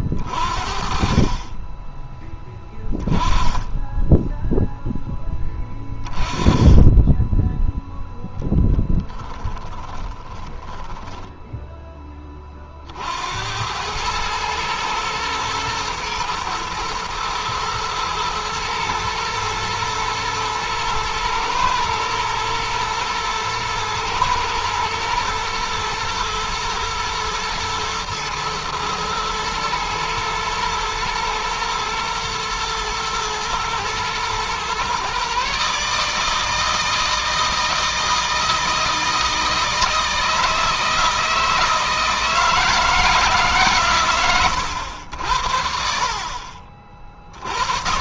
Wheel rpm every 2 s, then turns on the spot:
30, 10, 0, 10, 10, 10, 50, 110, 120, 110, 110, 110, 110, 120, 110, 110, 120, 130, 160, 160, 160, 160, 80, 40.
8-12